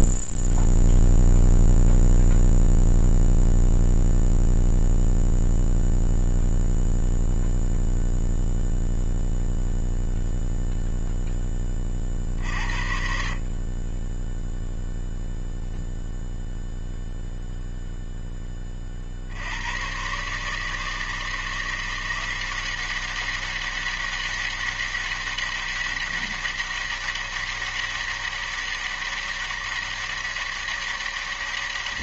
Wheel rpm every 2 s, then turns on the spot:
0, 0, 0, 0, 0, 0, 20, 30, 0, 0, 120, 180, 200, 200, 200, 200.
none